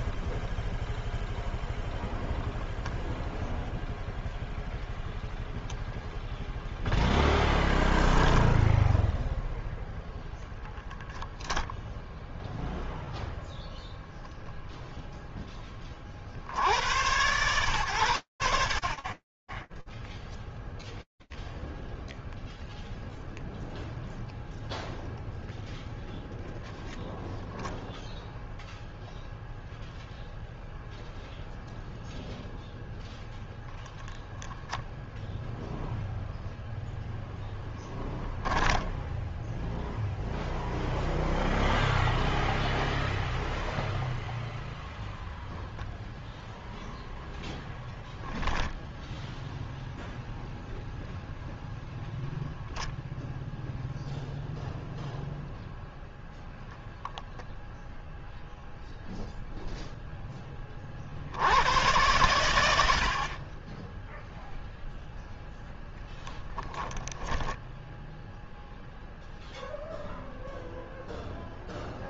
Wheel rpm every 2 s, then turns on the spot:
10, 0, 0, 0, 0, 0, 0, 0, 40, 70, 0, 0, 0, 10, 0, 0, 0, 0, 10, 0, 0, 0, 0, 0, 0, 0, 0, 0, 0, 0, 40, 80, 0, 10, 0, 0.
none